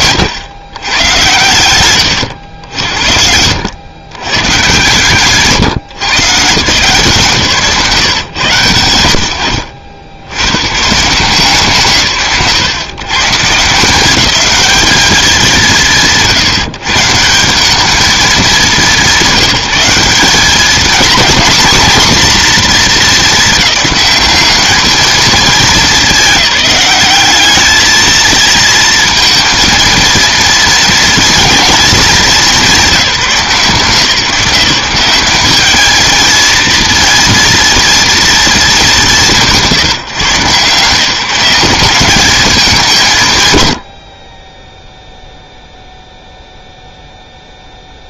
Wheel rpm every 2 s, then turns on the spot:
130, 70, 150, 150, 100, 120, 130, 210, 150, 180, 230, 230, 220, 200, 220, 230, 180, 170, 230, 200, 160, 180, 0, 0.
none